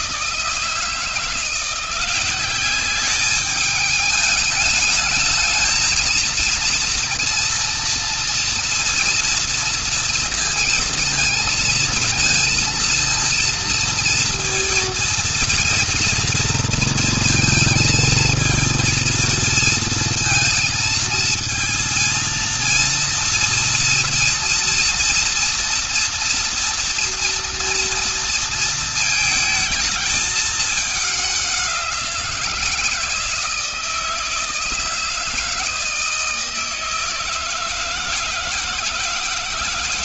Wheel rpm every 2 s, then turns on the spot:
160, 190, 210, 230, 230, 230, 230, 230, 230, 230, 230, 230, 230, 230, 230, 210, 170, 160, 160, 160.
none